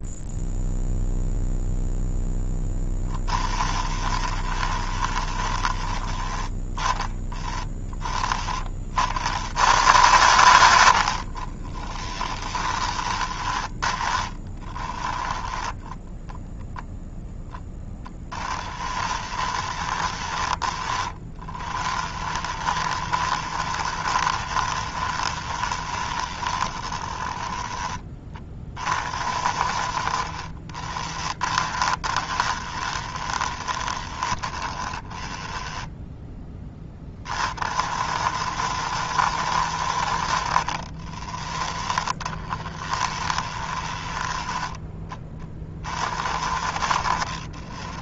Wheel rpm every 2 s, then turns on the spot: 0, 10, 20, 10, 40, 70, 20, 10, 0, 10, 20, 20, 20, 10, 30, 20, 20, 20, 20, 70, 30, 20, 10, 40.
2-6 10-16 18-28 30-36 40-44